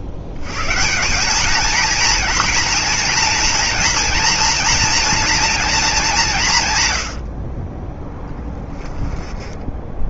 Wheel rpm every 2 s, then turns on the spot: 90, 230, 230, 130, 20.
8-10